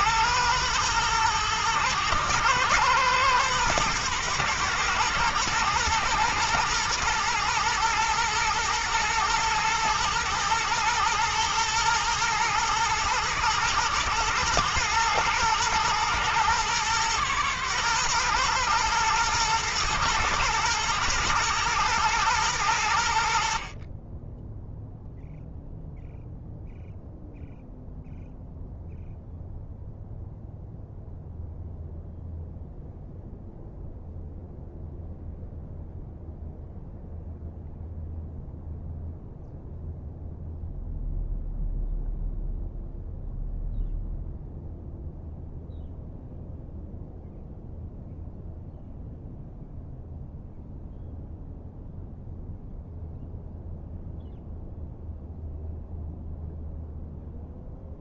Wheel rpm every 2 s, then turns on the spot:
110, 110, 110, 110, 120, 110, 110, 110, 120, 120, 120, 90, 0, 0, 0, 0, 0, 0, 0, 0, 0, 0, 0, 0, 0, 0, 0, 0, 0.
none